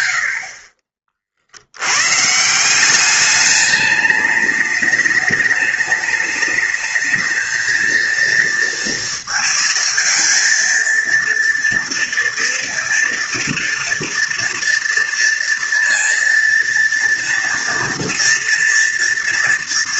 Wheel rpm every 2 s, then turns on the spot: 70, 160, 210, 210, 230, 230, 230, 230, 230, 230.
none